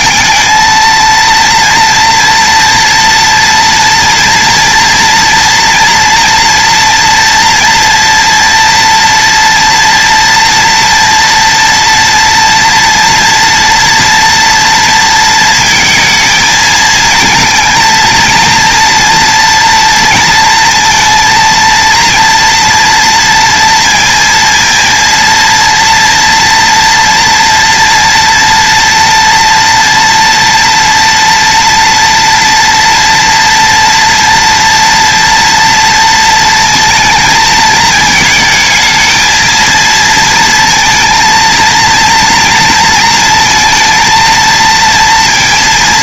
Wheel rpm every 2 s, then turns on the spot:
220, 230, 240, 240, 230, 230, 240, 240, 230, 230, 230, 230, 230, 230, 230, 230, 240, 230, 230, 220, 230, 230, 230.
none